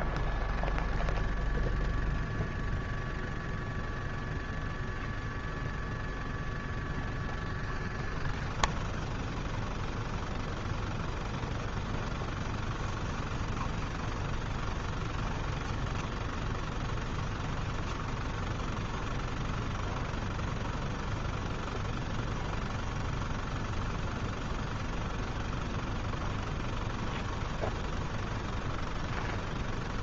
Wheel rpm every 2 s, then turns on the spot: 0, 0, 0, 0, 0, 0, 0, 0, 0, 0, 0, 0, 0, 0, 0.
none